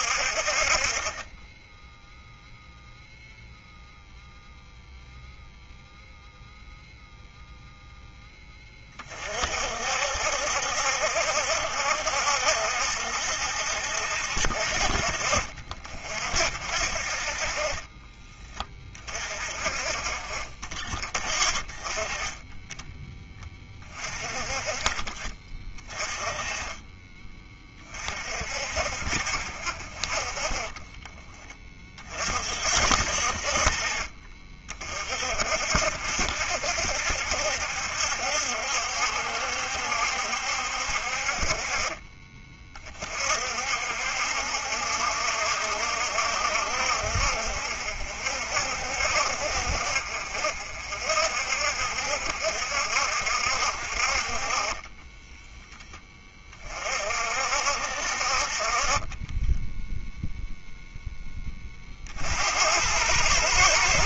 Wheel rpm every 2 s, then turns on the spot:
40, 0, 0, 0, 20, 70, 70, 60, 50, 30, 30, 10, 30, 20, 50, 20, 50, 40, 70, 70, 60, 30, 70, 70, 60, 50, 60, 20, 40, 40, 0, 80.
none